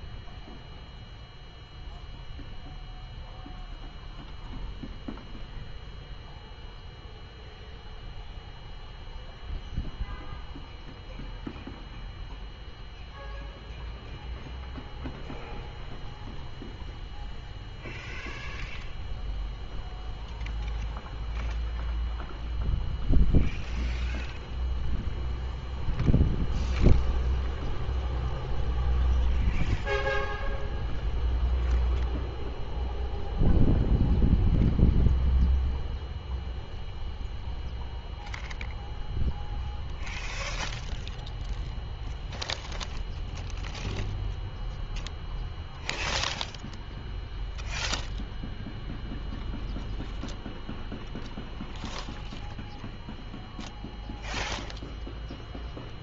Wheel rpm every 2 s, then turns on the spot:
0, 0, 0, 0, 0, 0, 0, 0, 0, 0, 0, 0, 0, 0, 0, 0, 0, 0, 0, 0, 0, 0, 0, 0, 0, 0, 0, 0.
none